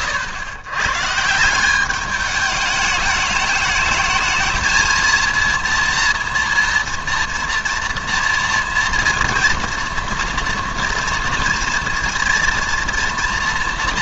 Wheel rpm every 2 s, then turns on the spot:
110, 210, 220, 230, 240, 230, 230.
none